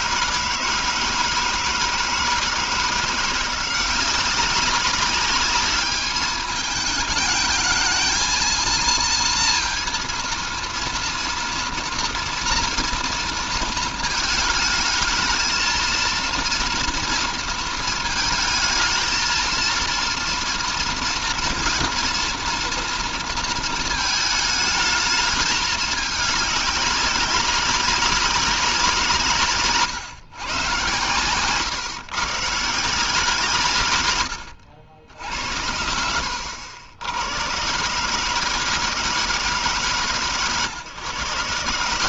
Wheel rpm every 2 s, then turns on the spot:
160, 170, 190, 210, 230, 230, 230, 220, 230, 220, 230, 230, 210, 200, 170, 120, 150, 70, 80, 160, 130.
none